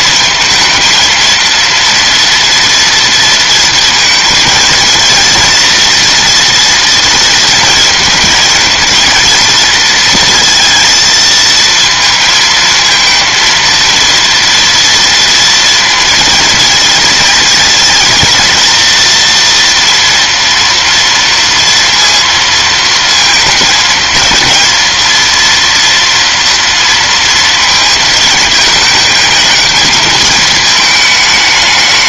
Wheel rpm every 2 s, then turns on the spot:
230, 230, 220, 230, 230, 230, 220, 230, 230, 230, 230, 230, 230, 230, 220, 220.
none